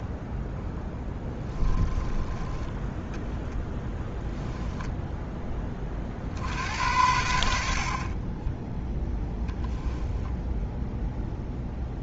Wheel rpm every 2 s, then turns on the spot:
10, 10, 0, 70, 10, 0.
0-2